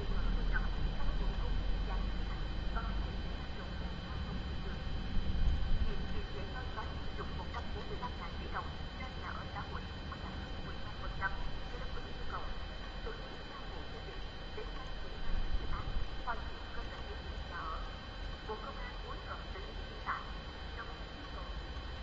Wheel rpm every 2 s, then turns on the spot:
0, 0, 0, 0, 0, 0, 0, 0, 0, 0, 0.
none